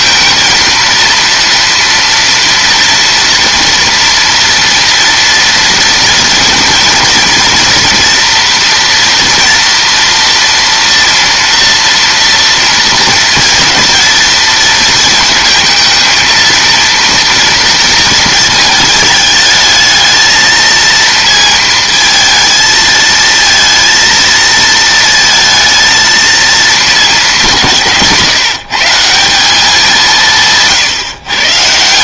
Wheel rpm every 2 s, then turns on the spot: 230, 230, 230, 230, 230, 230, 230, 230, 230, 210, 220, 220, 230, 220, 160, 150.
none